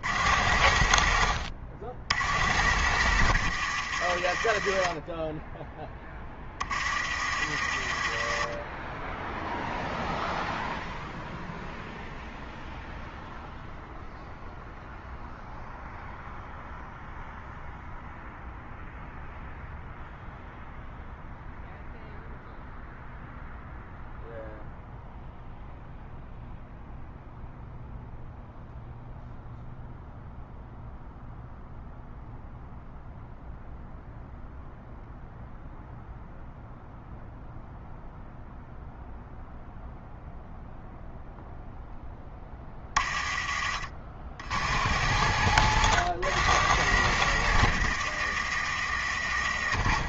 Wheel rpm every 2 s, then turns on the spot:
100, 90, 60, 30, 40, 0, 0, 0, 0, 0, 0, 0, 0, 0, 0, 0, 0, 0, 0, 0, 0, 20, 80, 120, 90.
0-4 6-8 44-50